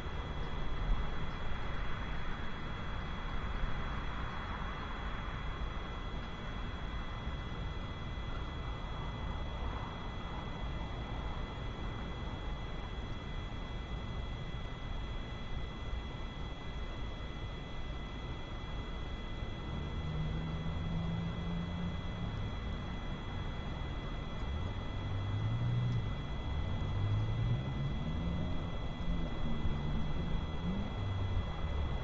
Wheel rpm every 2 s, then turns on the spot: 0, 0, 0, 0, 0, 0, 0, 0, 0, 0, 0, 0, 0, 0, 0, 0.
none